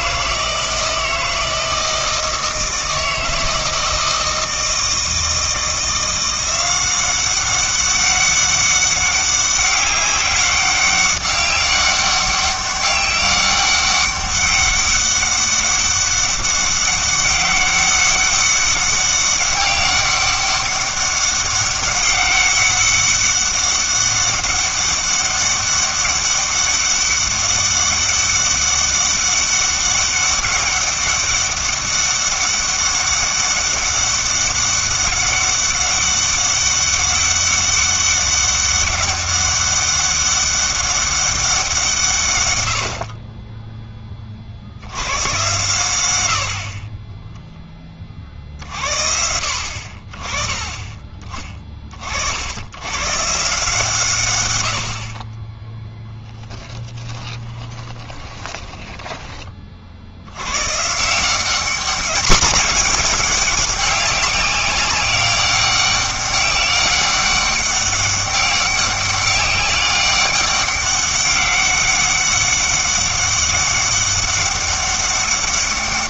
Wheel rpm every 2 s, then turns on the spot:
160, 160, 160, 180, 200, 200, 190, 200, 200, 200, 200, 200, 200, 200, 200, 200, 200, 200, 200, 200, 200, 110, 70, 50, 50, 20, 90, 90, 10, 10, 130, 210, 190, 200, 200, 200, 200, 200.
46-48 58-60